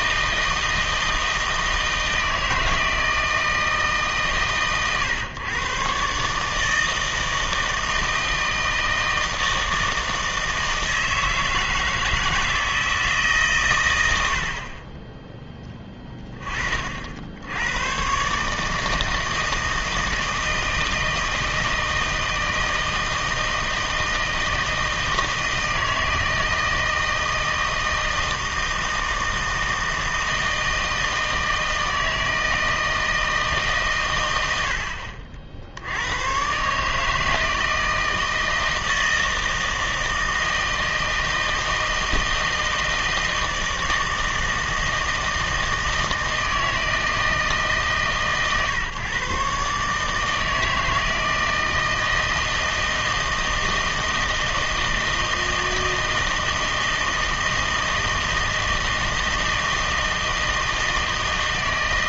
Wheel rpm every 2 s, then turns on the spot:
160, 160, 130, 150, 160, 160, 160, 50, 30, 150, 160, 160, 160, 160, 160, 160, 160, 80, 130, 160, 160, 160, 160, 160, 130, 160, 160, 160, 160, 160, 160.
none